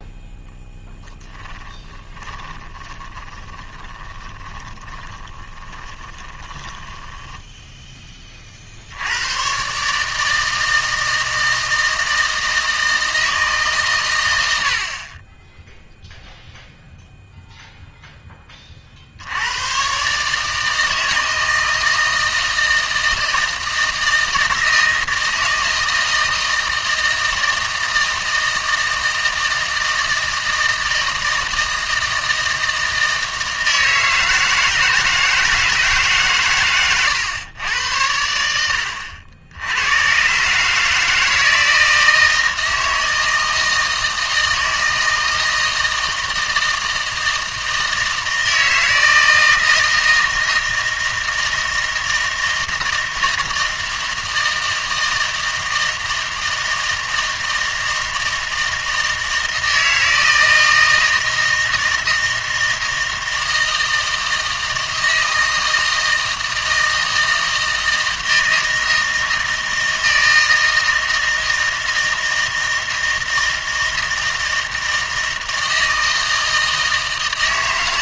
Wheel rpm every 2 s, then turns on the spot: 10, 20, 20, 10, 70, 160, 160, 60, 0, 40, 160, 160, 160, 160, 160, 160, 160, 160, 120, 80, 150, 160, 160, 160, 160, 160, 160, 160, 160, 160, 160, 160, 160, 160, 160, 160, 160, 160, 160.
2-8